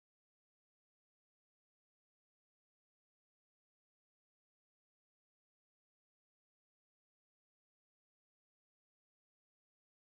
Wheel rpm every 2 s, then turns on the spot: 0, 0, 0, 0, 0.
none